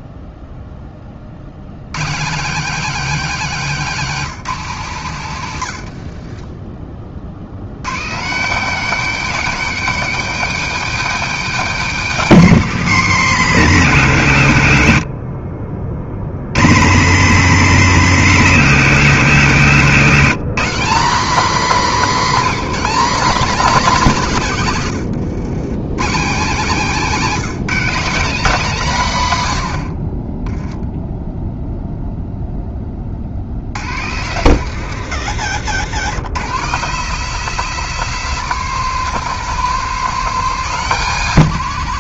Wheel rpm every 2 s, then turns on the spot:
20, 180, 170, 30, 230, 260, 200, 110, 110, 190, 190, 190, 130, 200, 220, 10, 10, 130, 150, 190, 180.
6-8